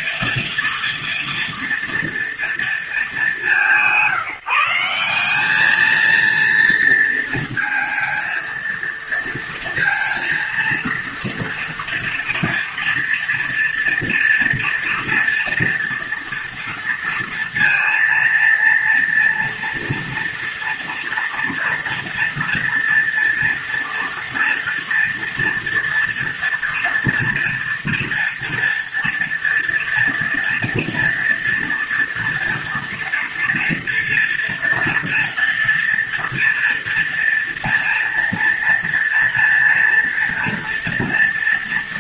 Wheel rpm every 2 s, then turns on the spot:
230, 200, 200, 230, 230, 230, 230, 240, 230, 230, 230, 230, 230, 230, 230, 230, 230, 230, 230, 230, 230.
none